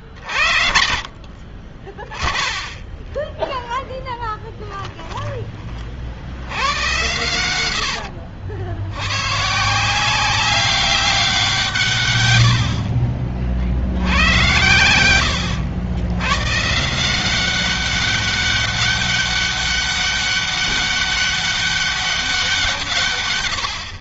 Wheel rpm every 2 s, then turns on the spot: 40, 20, 10, 80, 80, 190, 80, 90, 120, 200, 200, 180.
4-6